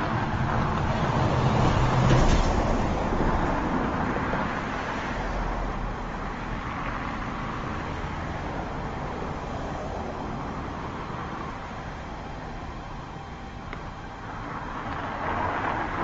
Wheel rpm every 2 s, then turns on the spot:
0, 0, 0, 0, 0, 0, 0, 0.
none